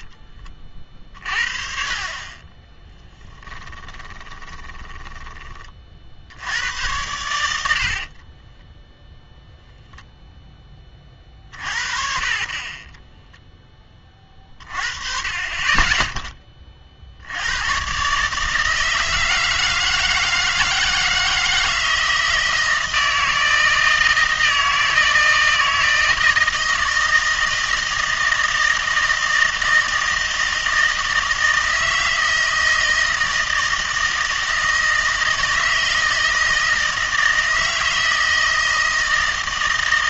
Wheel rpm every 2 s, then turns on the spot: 40, 10, 20, 90, 10, 20, 20, 30, 20, 160, 160, 160, 160, 160, 160, 160, 160, 160, 160, 160.
2-6 8-10